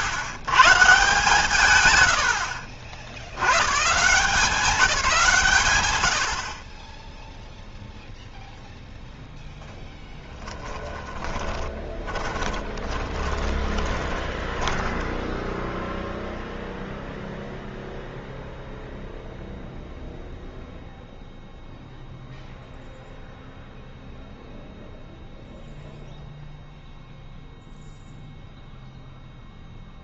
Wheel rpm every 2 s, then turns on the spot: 140, 70, 160, 60, 0, 10, 20, 20, 0, 0, 0, 0, 0, 0, 0.
10-16